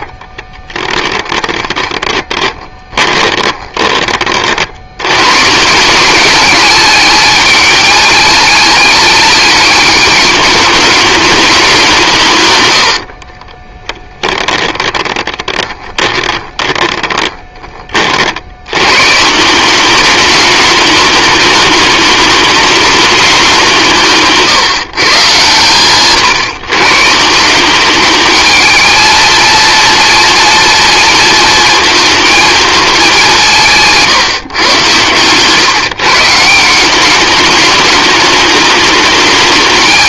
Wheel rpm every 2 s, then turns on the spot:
10, 20, 90, 210, 210, 210, 90, 20, 20, 120, 210, 210, 130, 140, 220, 230, 220, 120, 190, 210.
0-4 12-18